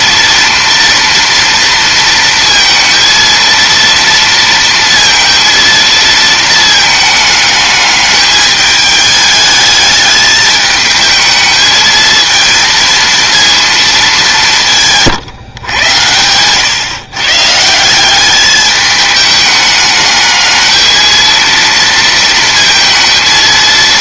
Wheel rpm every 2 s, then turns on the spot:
230, 230, 230, 220, 210, 220, 230, 170, 120, 210, 220, 230.
none